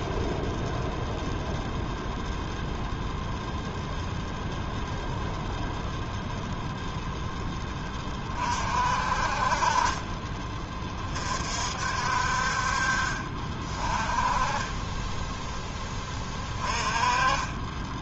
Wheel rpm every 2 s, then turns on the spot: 0, 0, 0, 0, 50, 30, 50, 20, 20.
14-16